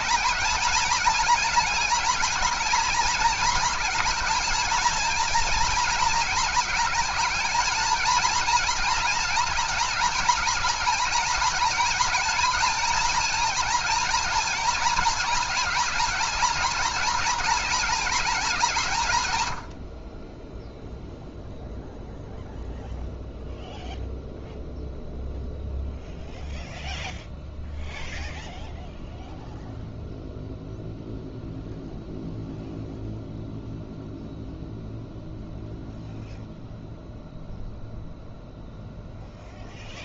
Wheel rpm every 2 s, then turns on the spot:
230, 220, 230, 220, 230, 220, 240, 220, 220, 120, 0, 0, 0, 0, 0, 0, 0, 0, 0, 0.
none